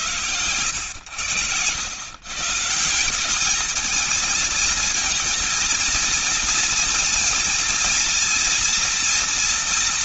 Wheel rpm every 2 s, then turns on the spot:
110, 150, 230, 230, 230.
none